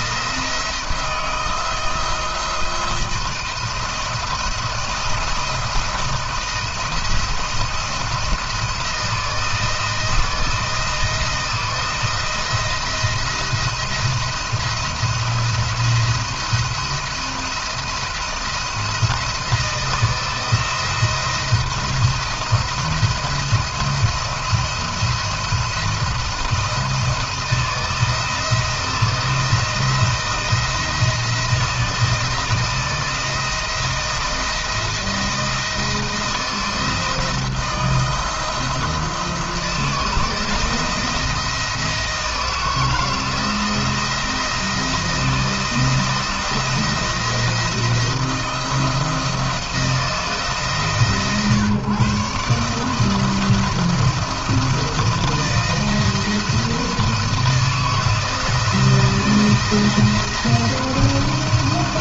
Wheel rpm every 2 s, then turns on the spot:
160, 170, 170, 170, 160, 160, 170, 170, 170, 160, 170, 170, 160, 170, 160, 170, 170, 170, 160, 160, 160, 160, 170, 170, 170, 150, 150, 170, 160, 160, 170.
none